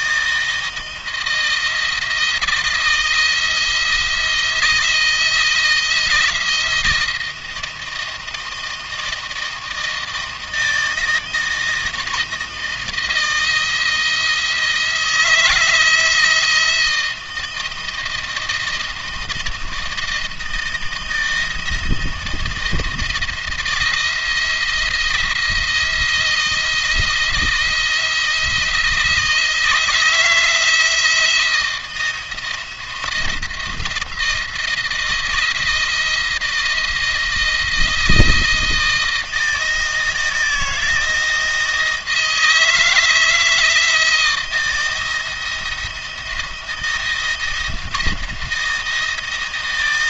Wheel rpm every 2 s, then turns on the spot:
160, 160, 160, 170, 160, 160, 170, 170, 170, 160, 160, 160, 170, 170, 170, 170, 170, 170, 170, 160, 170, 160, 170, 170, 170.
none